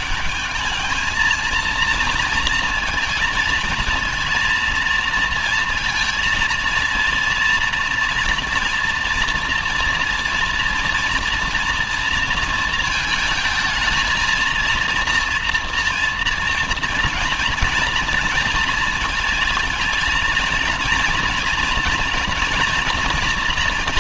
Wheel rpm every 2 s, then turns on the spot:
220, 230, 230, 230, 230, 230, 220, 230, 230, 230, 240, 230.
none